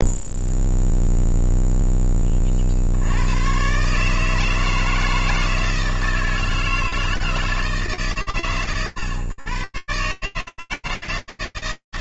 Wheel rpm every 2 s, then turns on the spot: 0, 120, 160, 160, 120, 160.
none